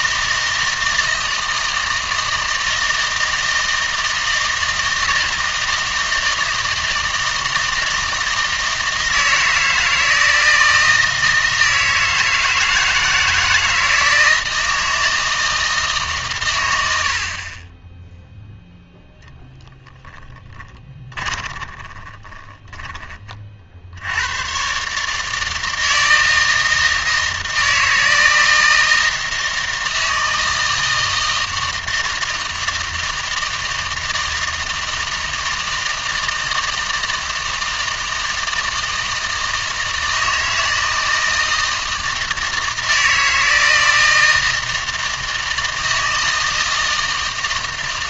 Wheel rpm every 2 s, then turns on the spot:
160, 160, 160, 160, 160, 160, 160, 160, 90, 0, 20, 20, 130, 160, 160, 160, 160, 160, 160, 160, 160, 160, 160, 160.
20-24